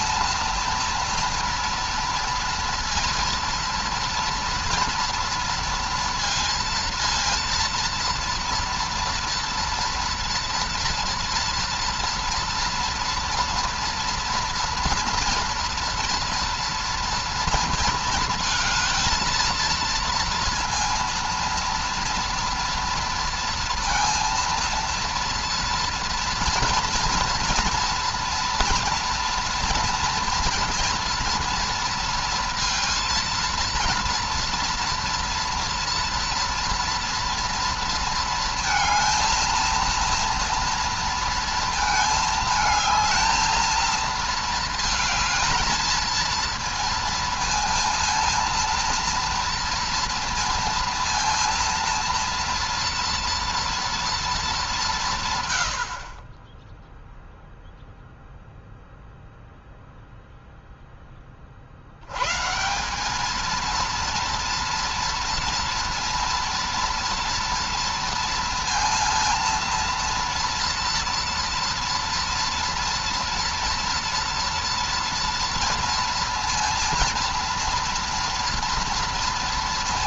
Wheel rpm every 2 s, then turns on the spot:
230, 230, 230, 230, 230, 230, 230, 230, 230, 220, 230, 230, 230, 230, 230, 230, 230, 230, 230, 220, 230, 220, 220, 230, 230, 230, 230, 210, 20, 0, 0, 140, 230, 230, 230, 230, 230, 230, 230, 230.
none